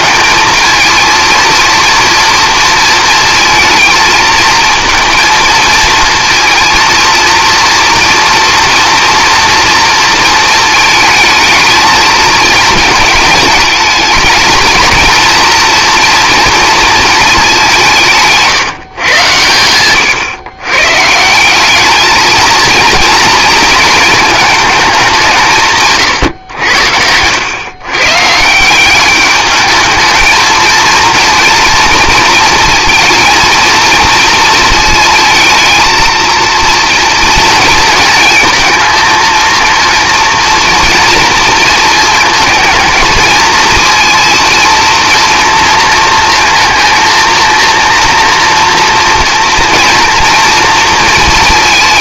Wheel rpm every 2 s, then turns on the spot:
220, 230, 220, 230, 230, 220, 220, 230, 220, 140, 140, 230, 190, 90, 190, 230, 230, 220, 230, 230, 230, 220, 230, 230, 230, 230.
none